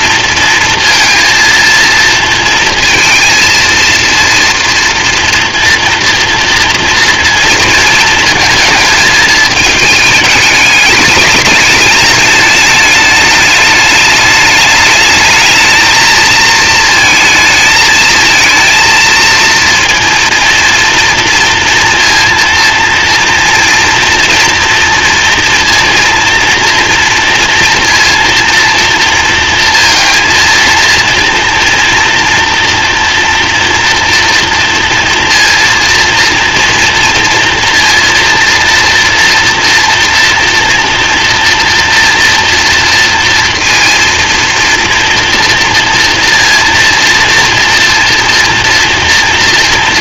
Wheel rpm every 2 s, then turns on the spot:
230, 230, 230, 230, 220, 210, 210, 210, 230, 230, 230, 230, 230, 230, 230, 230, 240, 230, 240, 230, 230, 230, 230, 230, 230.
none